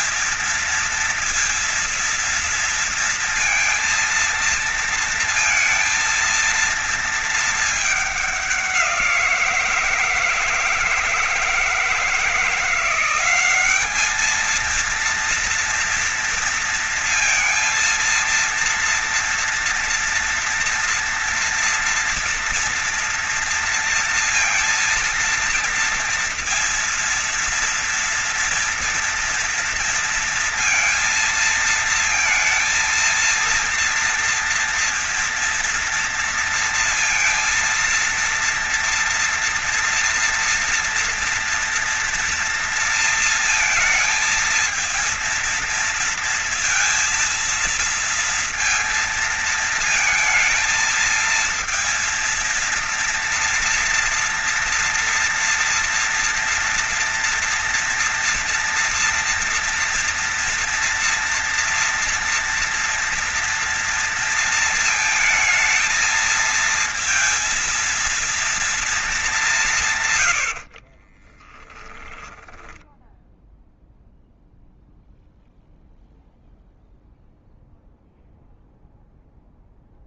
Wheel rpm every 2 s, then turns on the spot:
230, 230, 230, 230, 200, 160, 160, 220, 240, 230, 230, 230, 230, 230, 230, 230, 230, 230, 230, 230, 230, 230, 230, 230, 230, 220, 230, 230, 230, 230, 230, 230, 230, 220, 230, 130, 10, 0, 0, 0.
70-74